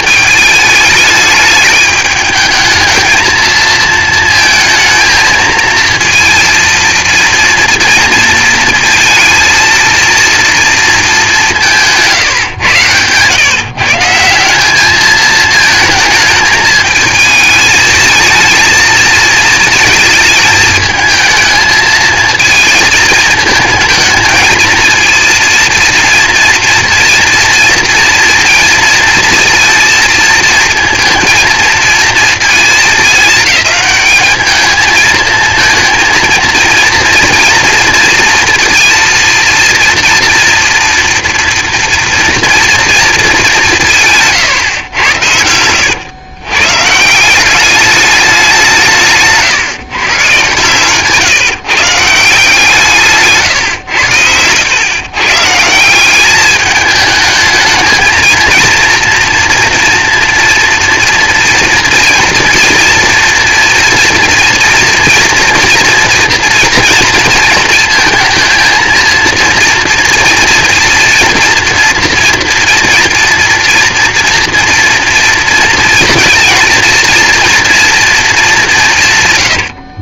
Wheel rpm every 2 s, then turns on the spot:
210, 220, 220, 230, 230, 230, 130, 190, 210, 220, 220, 220, 220, 230, 230, 230, 220, 220, 230, 230, 230, 240, 120, 130, 180, 130, 160, 110, 210, 230, 230, 240, 230, 230, 230, 230, 230, 230, 230, 190.
44-46 50-52